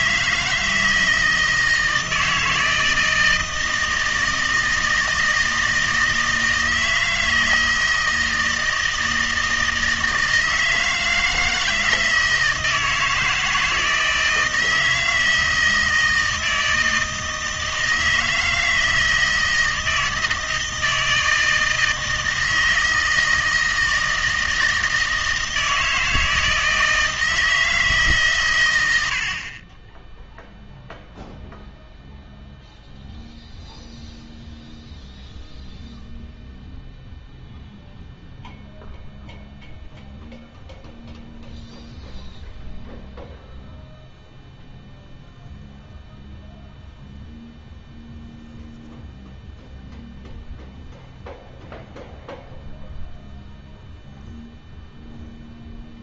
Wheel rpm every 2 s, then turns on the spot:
160, 160, 160, 160, 160, 160, 160, 160, 160, 160, 160, 160, 160, 160, 110, 0, 0, 0, 0, 0, 0, 0, 0, 0, 0, 0, 0, 0.
none